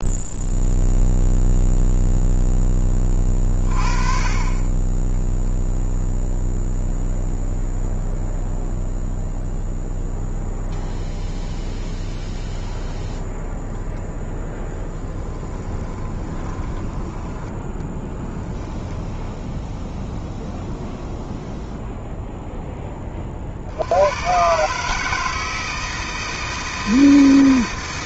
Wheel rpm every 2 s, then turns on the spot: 0, 20, 0, 0, 0, 0, 0, 10, 10, 0, 0, 40, 160, 160.
14-16